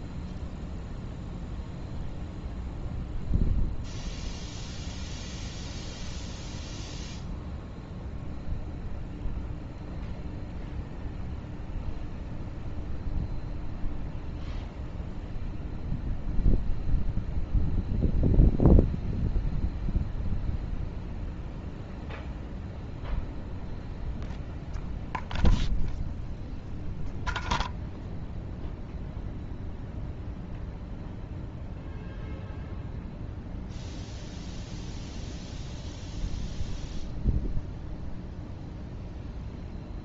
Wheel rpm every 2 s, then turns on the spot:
0, 0, 0, 0, 0, 0, 0, 0, 0, 0, 0, 0, 0, 0, 0, 0, 0, 0, 0, 0.
none